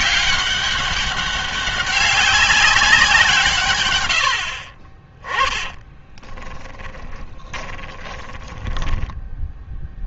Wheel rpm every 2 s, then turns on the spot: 200, 190, 50, 20, 10.
6-10